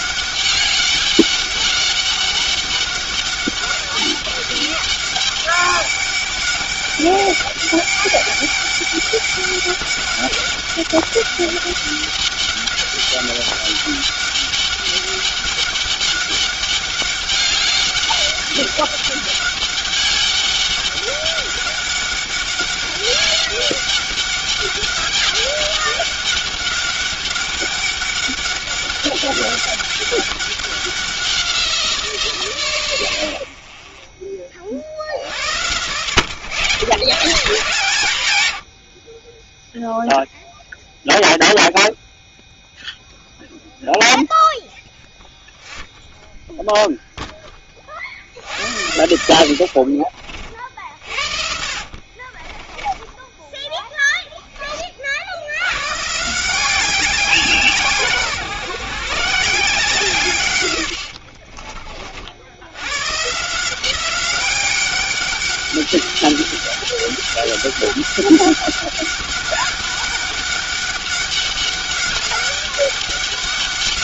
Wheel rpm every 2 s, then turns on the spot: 200, 200, 200, 200, 200, 200, 200, 200, 200, 200, 200, 200, 200, 200, 200, 190, 110, 60, 120, 60, 0, 0, 0, 0, 70, 50, 10, 40, 190, 150, 90, 110, 200, 200, 200, 200, 200.
50-54 60-62